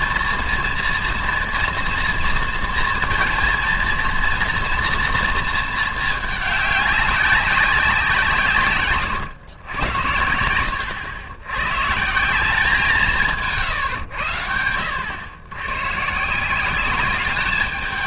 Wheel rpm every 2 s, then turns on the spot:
230, 230, 230, 210, 150, 90, 180, 90, 170.
none